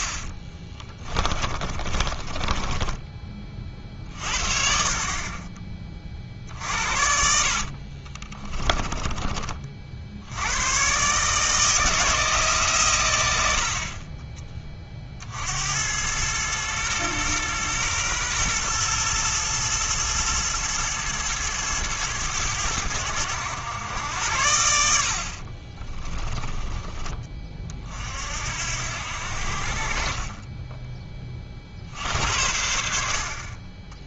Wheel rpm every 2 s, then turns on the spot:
30, 20, 50, 60, 20, 110, 150, 30, 110, 120, 110, 100, 80, 20, 70, 20, 70.
0-4 6-8